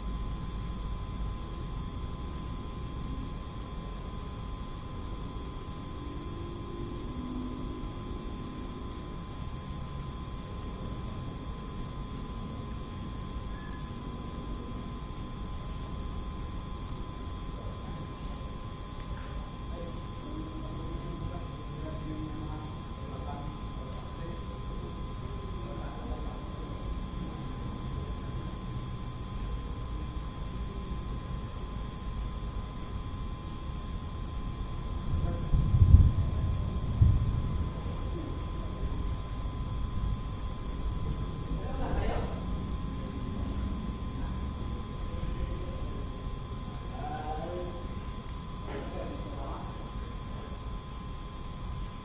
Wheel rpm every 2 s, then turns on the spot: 0, 0, 0, 0, 0, 0, 0, 0, 0, 0, 0, 0, 0, 0, 0, 0, 0, 0, 0, 0, 0, 0, 0, 0, 0, 0.
none